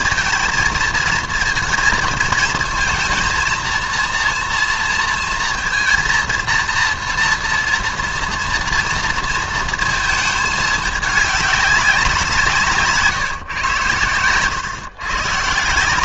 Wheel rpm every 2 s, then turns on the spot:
220, 230, 230, 230, 230, 210, 160, 120.
none